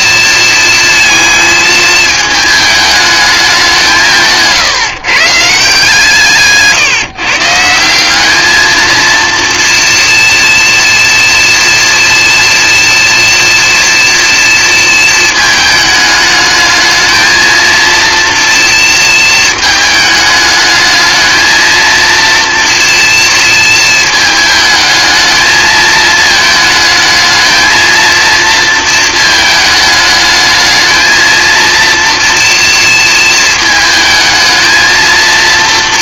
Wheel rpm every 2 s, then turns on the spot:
230, 210, 140, 150, 230, 230, 240, 230, 220, 230, 220, 230, 220, 220, 220, 220, 230, 220.
none